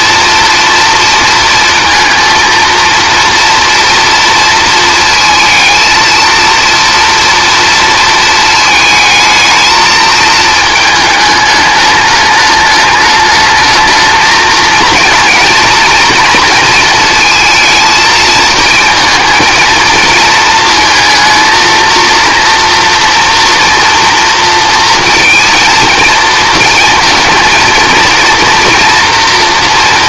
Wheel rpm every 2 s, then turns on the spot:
230, 230, 230, 230, 220, 220, 210, 220, 230, 220, 220, 240, 230, 230, 240.
none